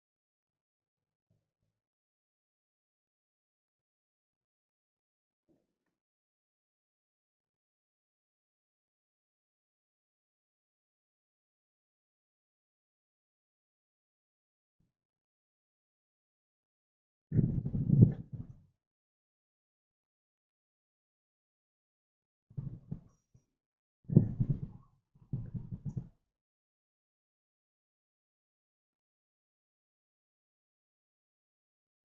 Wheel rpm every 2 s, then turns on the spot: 0, 0, 0, 0, 0, 0, 0, 0, 0, 0, 0, 0, 0, 0, 0, 0.
none